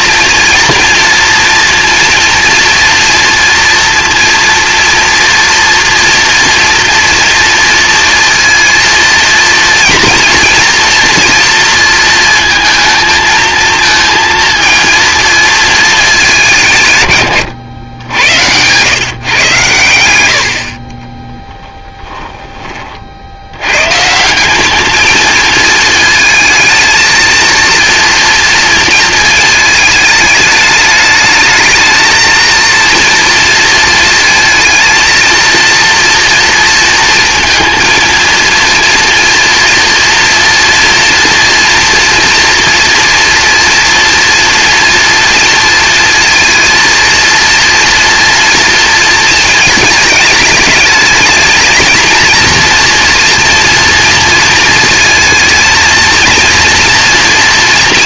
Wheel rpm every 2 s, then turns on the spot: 230, 230, 240, 240, 230, 230, 230, 230, 170, 120, 40, 30, 210, 220, 230, 210, 230, 230, 230, 230, 240, 240, 230, 230, 230, 210, 230, 220, 230.
none